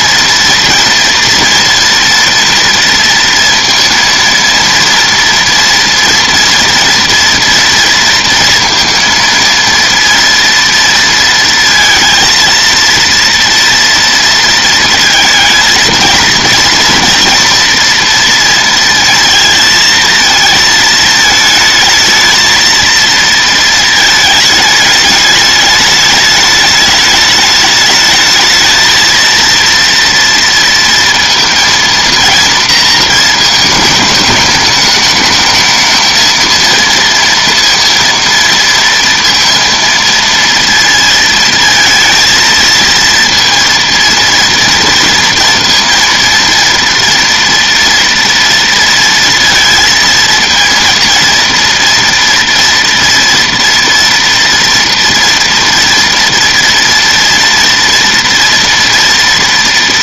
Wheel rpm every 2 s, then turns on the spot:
230, 230, 230, 230, 230, 230, 230, 230, 230, 230, 220, 230, 210, 210, 220, 230, 230, 220, 230, 230, 230, 230, 230, 230, 230, 230, 230, 230, 240, 230.
none